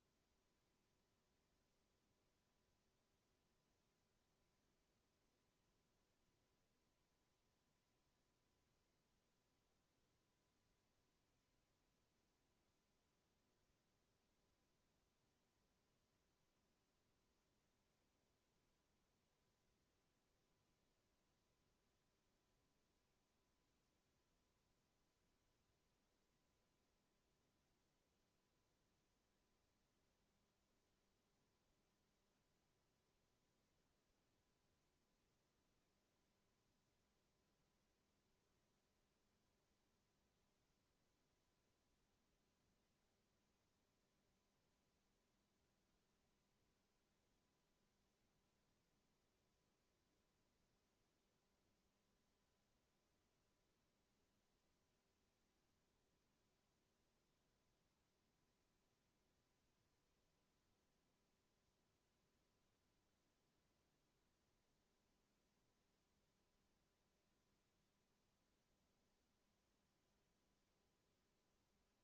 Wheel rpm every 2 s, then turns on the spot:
0, 0, 0, 0, 0, 0, 0, 0, 0, 0, 0, 0, 0, 0, 0, 0, 0, 0, 0, 0, 0, 0, 0, 0, 0, 0, 0, 0, 0, 0, 0, 0, 0, 0, 0, 0.
none